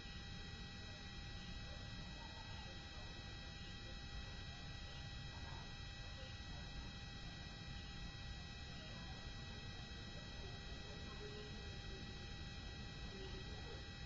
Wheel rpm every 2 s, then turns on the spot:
0, 0, 0, 0, 0, 0, 0.
none